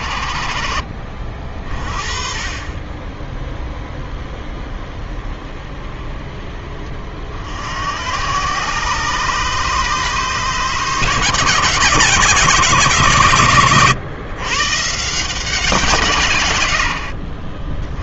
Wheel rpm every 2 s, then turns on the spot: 50, 20, 10, 30, 130, 150, 140, 150, 110.
none